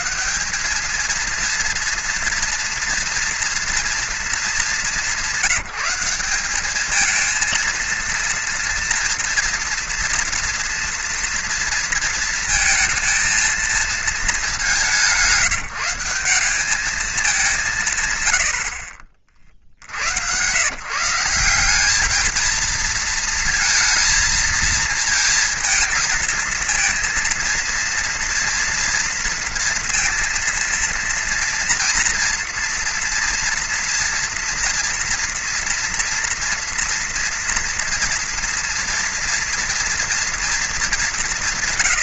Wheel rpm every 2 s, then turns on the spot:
220, 230, 210, 210, 230, 240, 230, 190, 200, 60, 140, 220, 220, 220, 230, 230, 230, 240, 230, 230, 210.
none